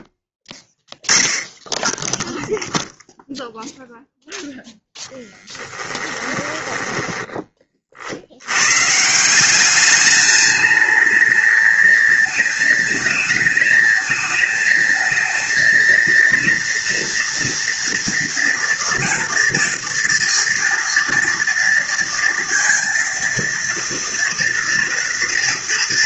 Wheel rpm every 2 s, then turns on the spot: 0, 0, 10, 10, 160, 220, 220, 220, 230, 230, 230, 230, 230.
4-8